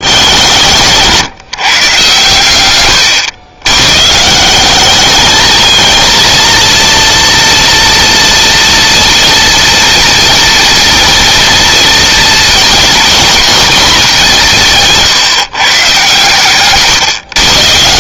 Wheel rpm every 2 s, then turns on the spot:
160, 110, 200, 230, 230, 240, 240, 160, 130.
none